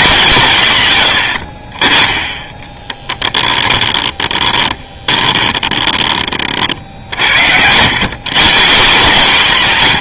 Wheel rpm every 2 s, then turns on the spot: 140, 10, 20, 40, 160.
2-6